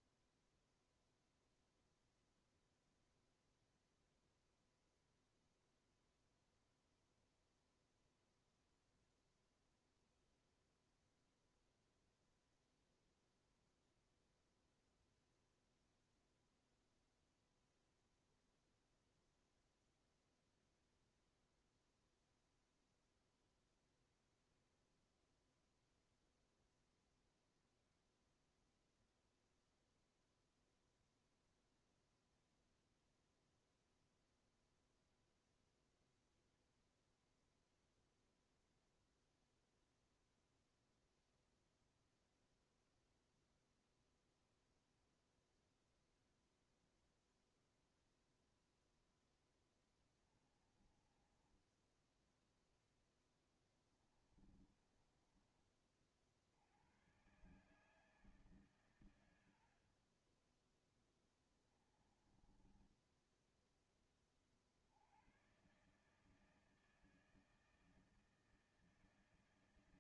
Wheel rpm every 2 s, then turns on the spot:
0, 0, 0, 0, 0, 0, 0, 0, 0, 0, 0, 0, 0, 0, 0, 0, 0, 0, 0, 0, 0, 0, 0, 0, 0, 20, 10, 20, 60, 150, 40, 20, 30, 150, 160.
50-56 62-64